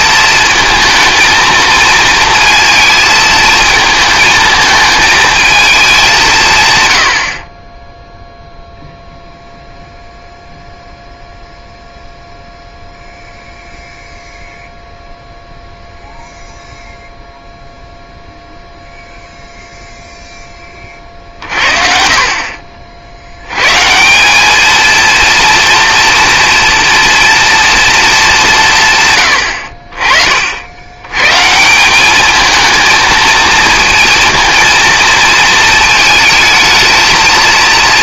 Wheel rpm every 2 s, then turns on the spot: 220, 220, 220, 150, 0, 0, 0, 0, 0, 0, 20, 50, 210, 230, 160, 70, 220, 230, 220.
none